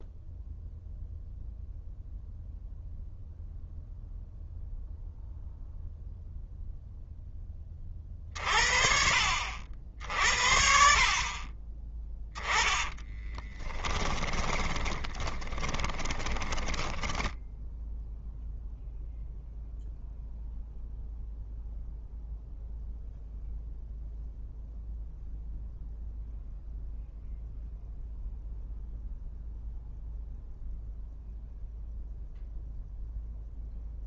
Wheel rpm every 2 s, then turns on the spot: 0, 0, 0, 0, 50, 60, 10, 10, 10, 0, 0, 0, 0, 0, 0, 0, 0.
12-18